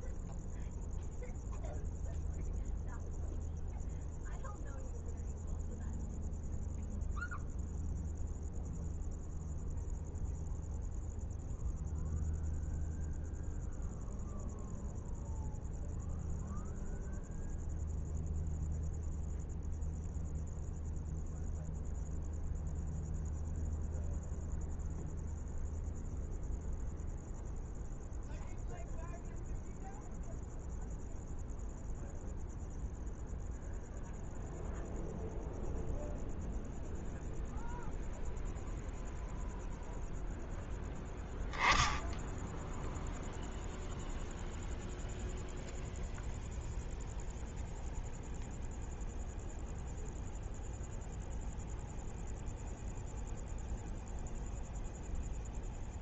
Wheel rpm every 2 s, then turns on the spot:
0, 0, 0, 0, 0, 0, 0, 0, 0, 0, 0, 0, 0, 0, 0, 0, 0, 0, 0, 0, 0, 0, 0, 0, 0, 0, 0, 0.
none